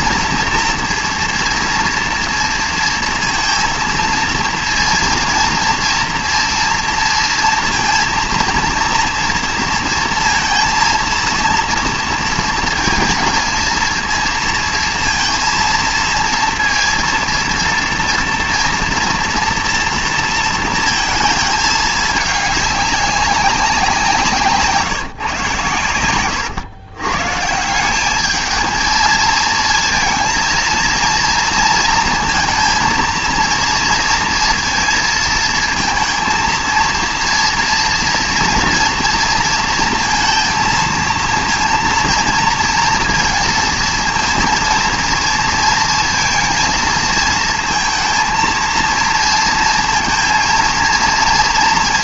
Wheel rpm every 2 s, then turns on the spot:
240, 230, 230, 230, 230, 230, 230, 230, 230, 230, 230, 200, 160, 110, 220, 230, 230, 230, 230, 230, 230, 230, 230, 230, 230, 230.
none